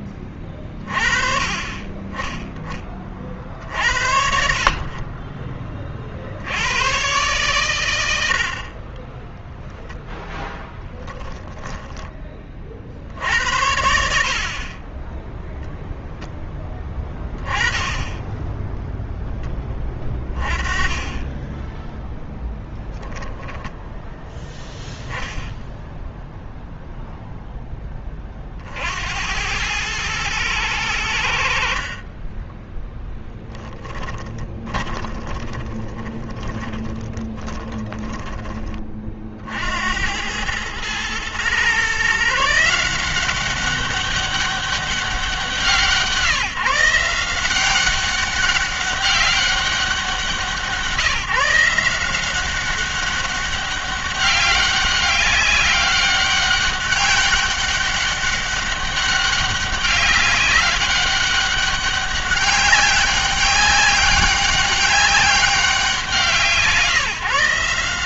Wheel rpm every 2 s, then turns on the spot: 30, 30, 50, 90, 50, 10, 50, 40, 10, 10, 20, 0, 10, 0, 50, 100, 20, 20, 20, 30, 100, 160, 190, 160, 200, 170, 190, 200, 200, 200, 200, 200, 200, 170.
10-12 32-38